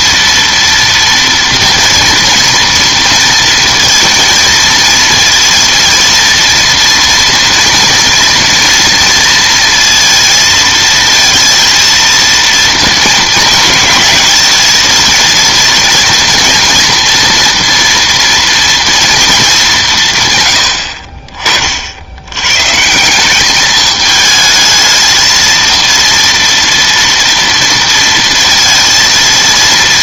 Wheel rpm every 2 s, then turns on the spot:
230, 230, 230, 230, 230, 230, 230, 220, 230, 230, 100, 120, 220, 230, 230.
none